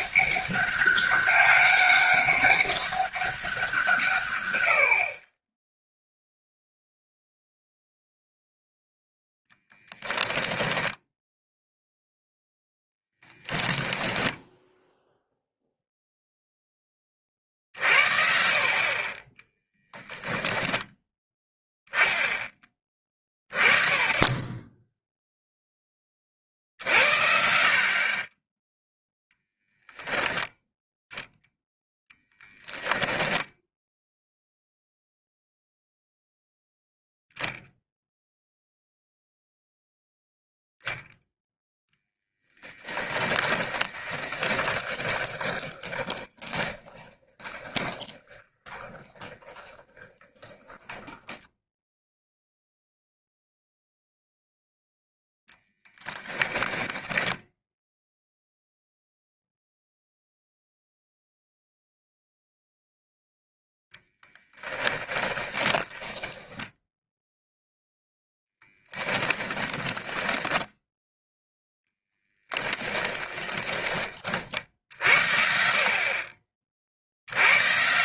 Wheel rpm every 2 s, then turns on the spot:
200, 200, 80, 0, 0, 10, 0, 0, 20, 50, 10, 20, 10, 60, 10, 0, 10, 0, 0, 0, 0, 10, 20, 20, 20, 10, 0, 0, 10, 0, 0, 0, 20, 0, 10, 10, 20, 60, 40.
20-22 42-52 56-58 64-66 68-70 72-74